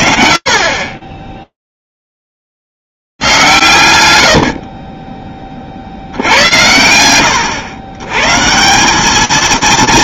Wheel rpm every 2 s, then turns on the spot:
40, 0, 110, 20, 100.
none